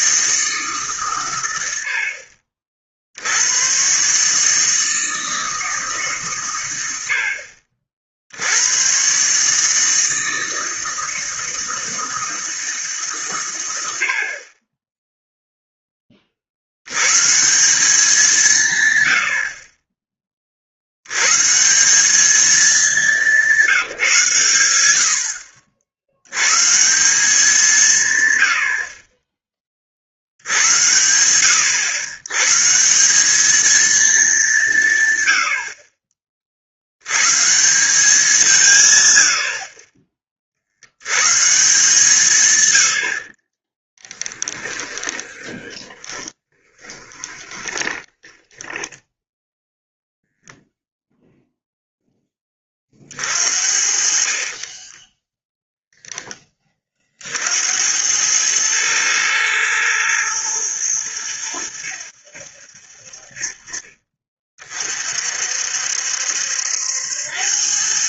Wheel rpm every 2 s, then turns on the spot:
150, 50, 160, 120, 80, 160, 160, 40, 70, 160, 40, 210, 110, 130, 70, 90, 150, 170, 50, 160, 50, 110, 20, 10, 10, 0, 20, 30, 10, 110, 110, 80, 40, 70.
44-50 54-56